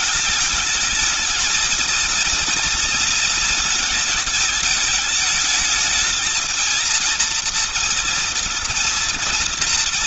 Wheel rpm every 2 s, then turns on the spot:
210, 230, 220, 230, 230.
none